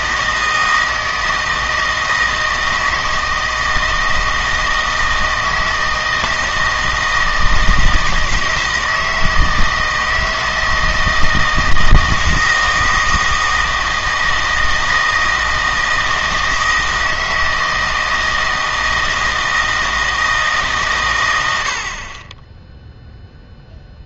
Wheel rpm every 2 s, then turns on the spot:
160, 160, 160, 160, 160, 160, 160, 160, 160, 160, 140, 0.
none